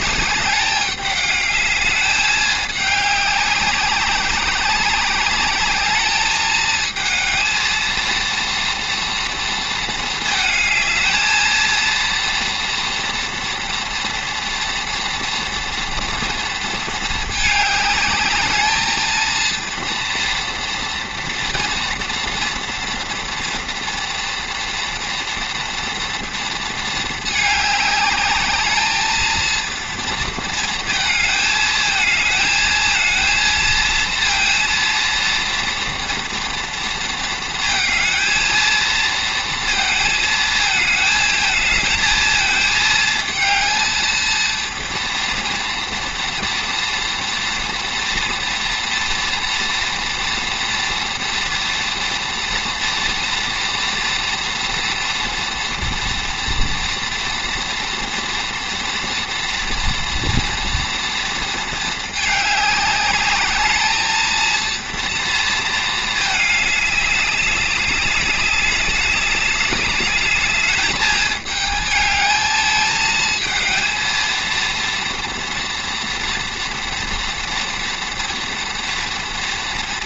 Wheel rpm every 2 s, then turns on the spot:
210, 200, 190, 220, 230, 220, 230, 230, 220, 220, 230, 230, 230, 230, 210, 230, 230, 230, 230, 230, 220, 220, 230, 230, 230, 230, 230, 230, 230, 230, 230, 210, 230, 210, 200, 210, 220, 230, 230, 240.
none